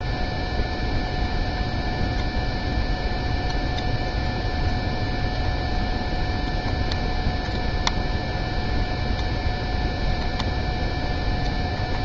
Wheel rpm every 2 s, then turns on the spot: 0, 0, 0, 0, 0, 0.
none